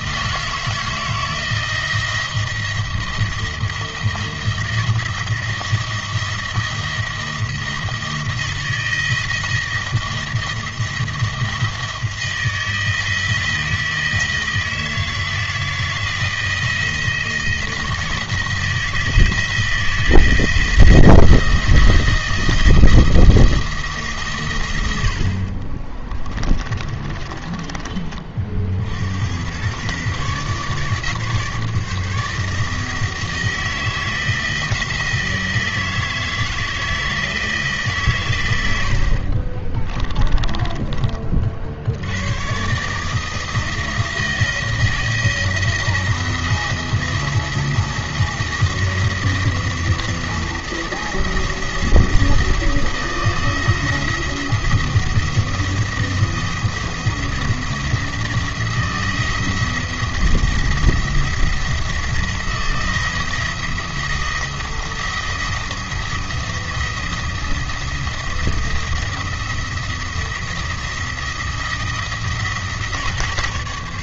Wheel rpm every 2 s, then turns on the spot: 160, 170, 170, 170, 170, 170, 160, 160, 170, 160, 170, 170, 100, 30, 50, 140, 160, 160, 160, 90, 20, 120, 160, 170, 170, 170, 170, 170, 170, 170, 170, 170, 170, 170, 160, 170, 160.
26-28 40-42